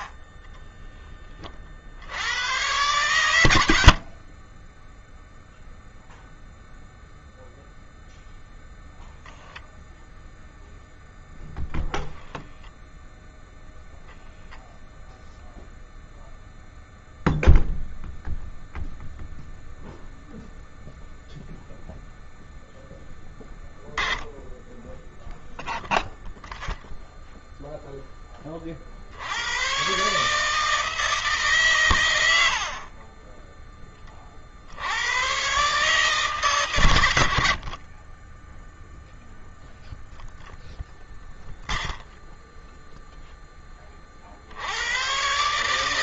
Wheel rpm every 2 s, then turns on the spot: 30, 90, 40, 0, 0, 0, 0, 0, 0, 0, 0, 0, 10, 0, 20, 150, 80, 50, 140, 20, 0, 0, 50.
0-2 4-6